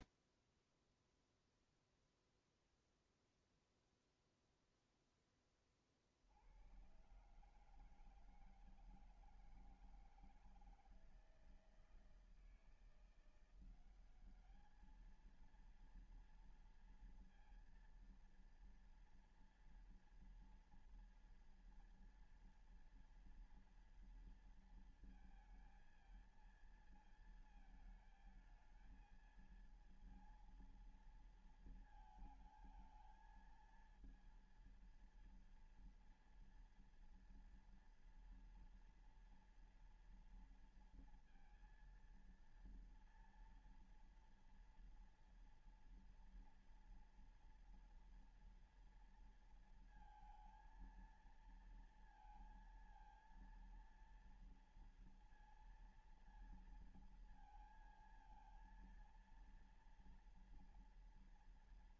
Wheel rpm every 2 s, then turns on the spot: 0, 0, 0, 70, 160, 170, 160, 200, 230, 230, 230, 230, 230, 230, 220, 230, 230, 230, 230, 230, 230, 230, 230, 230, 230, 230, 230, 230, 230, 230, 230.
none